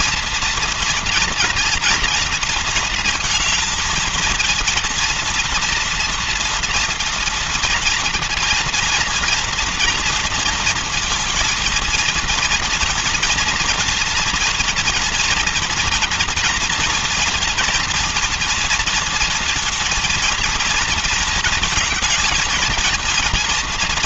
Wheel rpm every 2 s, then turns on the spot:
230, 230, 230, 230, 230, 230, 230, 230, 240, 230, 230, 230.
none